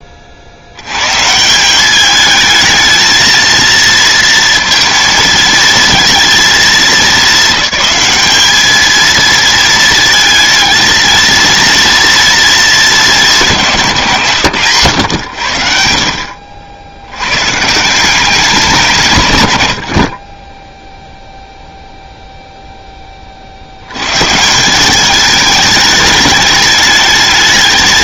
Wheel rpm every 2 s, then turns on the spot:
80, 220, 230, 220, 220, 220, 220, 110, 80, 180, 10, 0, 170, 210.
none